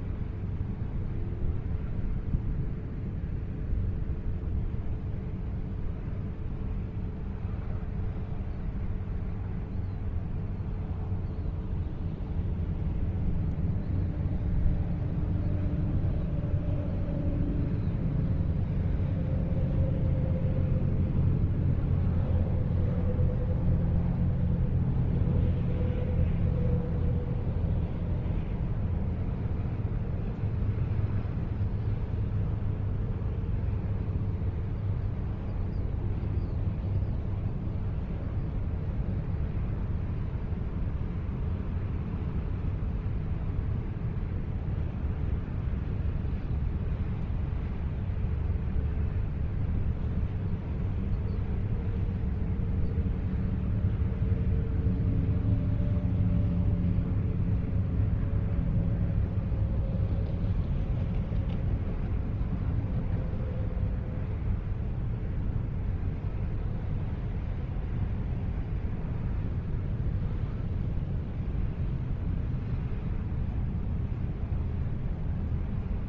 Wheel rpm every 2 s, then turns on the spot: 0, 0, 0, 0, 0, 0, 0, 0, 0, 0, 0, 0, 0, 0, 0, 0, 0, 0, 0, 0, 0, 0, 0, 0, 0, 0, 0, 0, 0, 0, 0, 0, 0, 0, 0, 0, 0, 0.
none